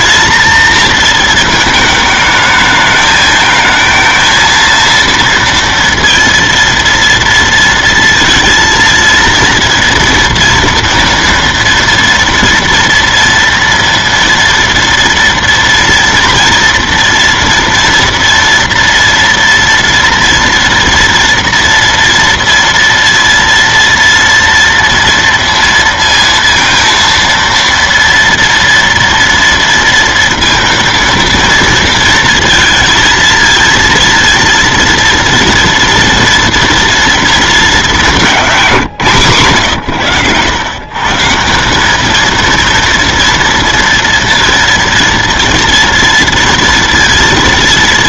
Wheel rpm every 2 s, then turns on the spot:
230, 210, 230, 230, 230, 230, 230, 230, 230, 230, 230, 230, 230, 230, 240, 230, 230, 230, 230, 210, 110, 220, 230, 230.
none